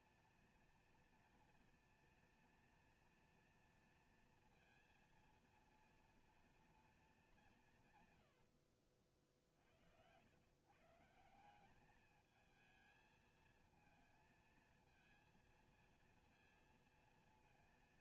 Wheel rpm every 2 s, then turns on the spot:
240, 230, 230, 230, 120, 100, 210, 220, 230.
none